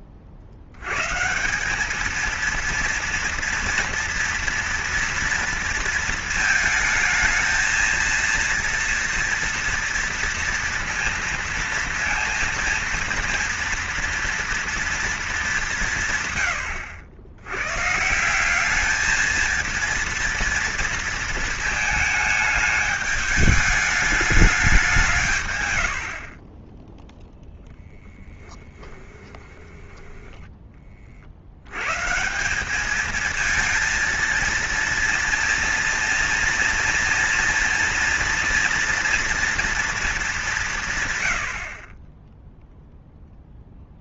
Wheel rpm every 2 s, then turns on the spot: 70, 230, 230, 230, 230, 230, 230, 230, 100, 190, 230, 220, 200, 30, 10, 10, 180, 230, 230, 230, 190, 0.
16-18 26-30